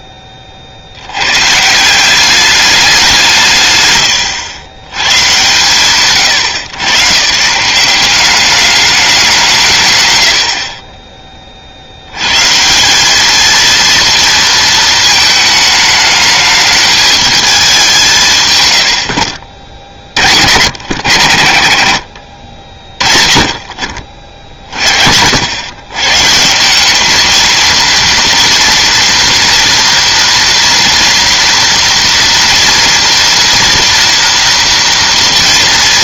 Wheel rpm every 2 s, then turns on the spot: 110, 170, 130, 140, 180, 30, 220, 220, 210, 50, 110, 40, 80, 220, 230, 230, 230, 230.
none